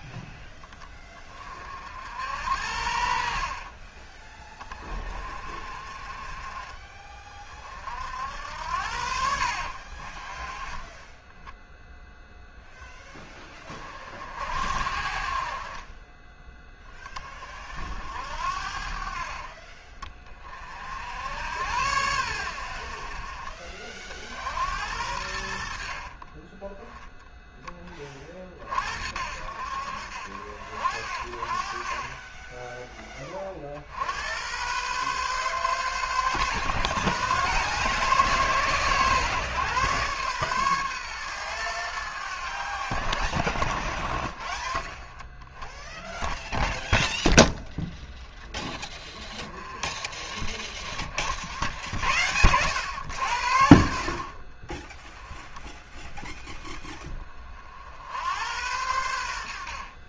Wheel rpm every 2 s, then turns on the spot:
20, 70, 30, 40, 80, 20, 10, 60, 20, 60, 50, 80, 80, 10, 60, 60, 20, 120, 110, 130, 130, 60, 30, 0, 10, 40, 100, 30, 10, 90.
none